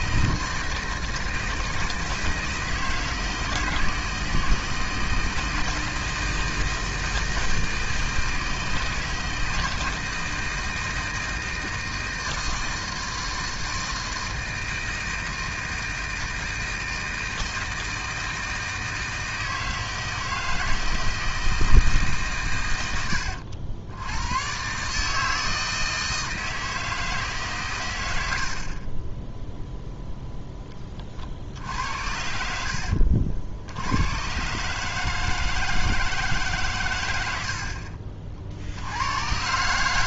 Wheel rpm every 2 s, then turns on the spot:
160, 160, 160, 160, 160, 160, 160, 160, 160, 160, 160, 110, 130, 160, 40, 10, 70, 150, 120, 70.
none